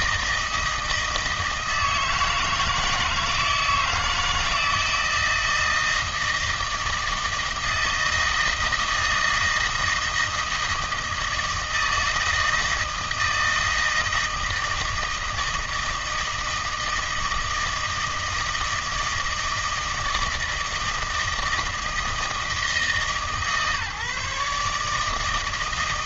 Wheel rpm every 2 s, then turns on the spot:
160, 160, 160, 160, 160, 160, 160, 160, 160, 160, 160, 160, 150.
none